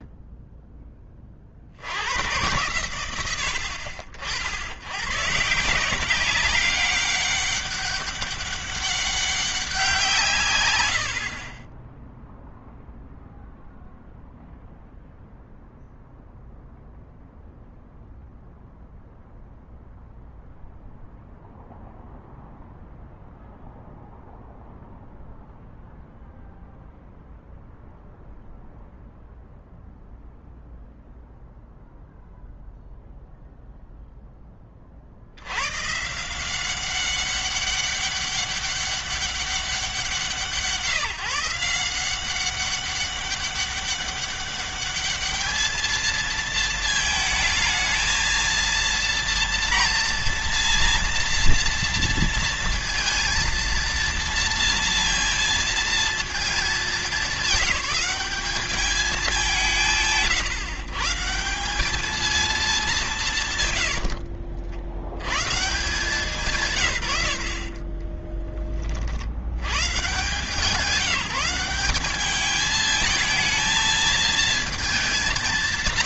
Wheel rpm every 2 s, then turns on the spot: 0, 110, 90, 190, 200, 120, 0, 0, 0, 0, 0, 0, 0, 0, 0, 0, 0, 20, 170, 200, 160, 190, 200, 220, 230, 230, 230, 230, 220, 200, 150, 210, 90, 150, 30, 170, 210, 220.
none